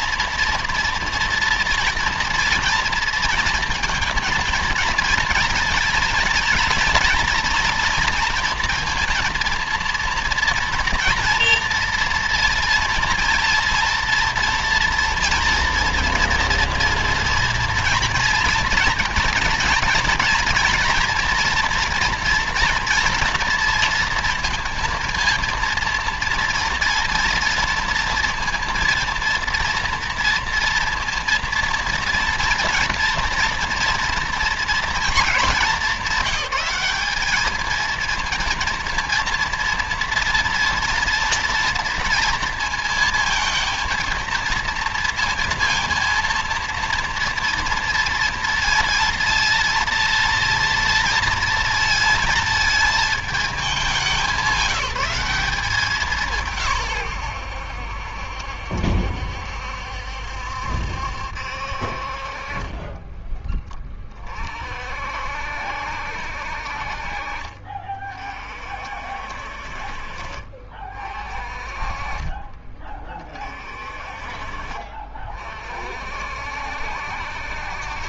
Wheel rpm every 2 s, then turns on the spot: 230, 230, 230, 230, 230, 240, 230, 230, 230, 230, 230, 240, 230, 240, 240, 230, 230, 230, 200, 230, 230, 230, 230, 230, 230, 230, 220, 190, 130, 70, 70, 30, 50, 50, 50, 40, 30, 40, 60.
62-64